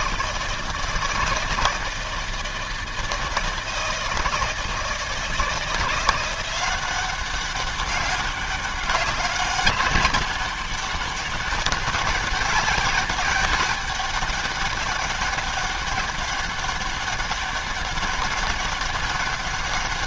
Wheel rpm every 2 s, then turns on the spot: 160, 160, 160, 190, 190, 200, 200, 200, 200, 200.
none